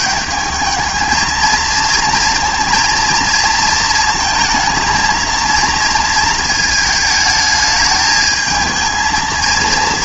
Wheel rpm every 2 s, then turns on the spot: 220, 230, 220, 220, 220.
none